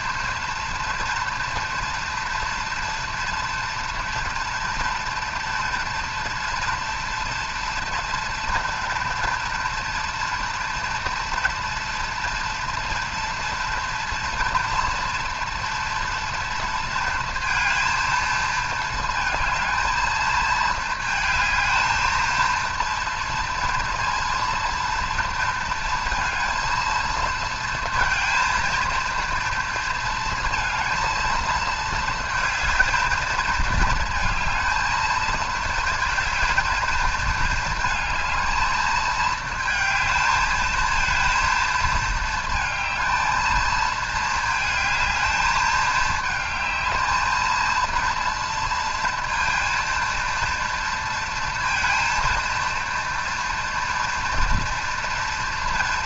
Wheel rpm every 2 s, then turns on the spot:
230, 230, 230, 230, 230, 230, 230, 230, 230, 220, 220, 230, 230, 230, 230, 230, 220, 220, 230, 220, 220, 220, 220, 220, 230, 230, 230, 230.
none